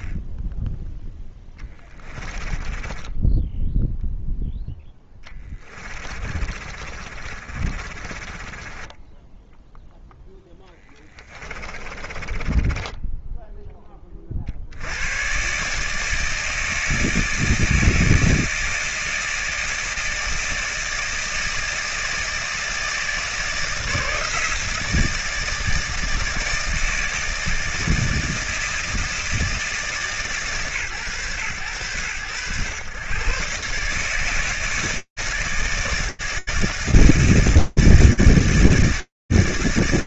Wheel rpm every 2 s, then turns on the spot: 10, 20, 10, 50, 20, 20, 20, 110, 160, 160, 160, 160, 160, 160, 160, 130, 130, 160, 160, 160.
2-14